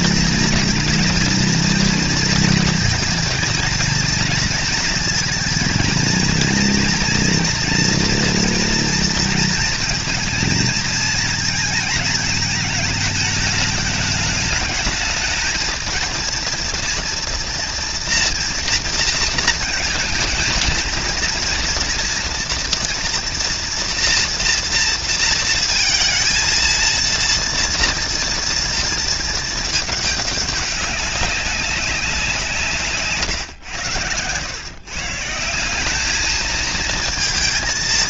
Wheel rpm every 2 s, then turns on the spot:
230, 230, 230, 240, 230, 230, 220, 210, 230, 230, 220, 230, 230, 230, 230, 200, 160, 130, 220.
none